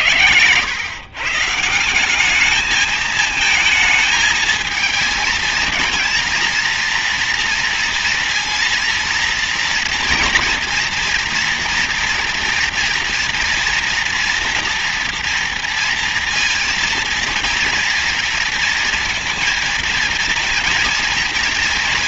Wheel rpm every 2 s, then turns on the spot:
110, 210, 220, 230, 230, 230, 230, 230, 230, 230, 230.
none